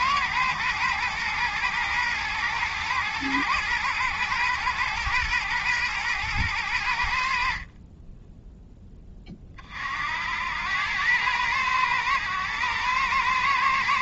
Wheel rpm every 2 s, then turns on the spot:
110, 110, 120, 90, 10, 100, 110.
none